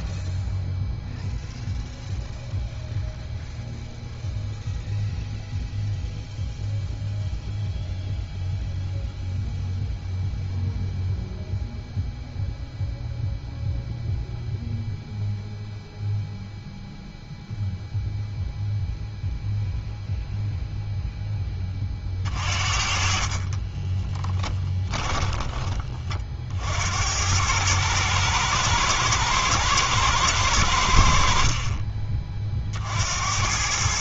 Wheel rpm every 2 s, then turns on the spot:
0, 0, 0, 0, 0, 0, 0, 0, 0, 0, 0, 40, 20, 70, 110, 80, 60.
24-26